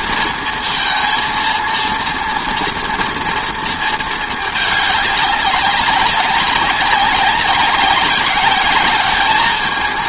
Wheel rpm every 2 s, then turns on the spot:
230, 240, 220, 190, 200.
none